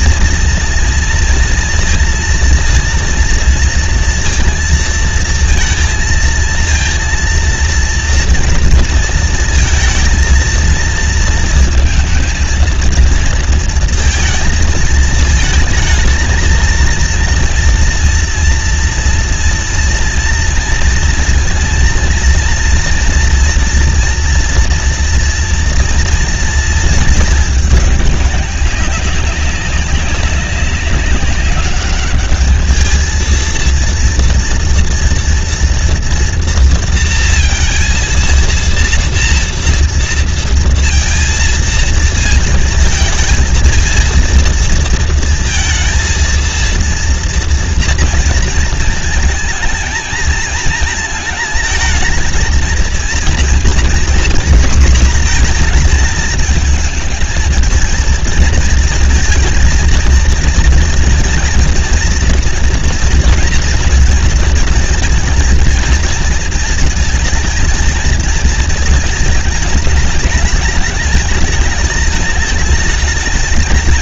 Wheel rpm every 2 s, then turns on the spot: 230, 230, 230, 230, 230, 230, 220, 230, 230, 230, 230, 230, 240, 230, 200, 190, 210, 230, 230, 230, 230, 230, 230, 230, 230, 220, 230, 240, 220, 220, 230, 240, 230, 230, 220, 210, 210.
none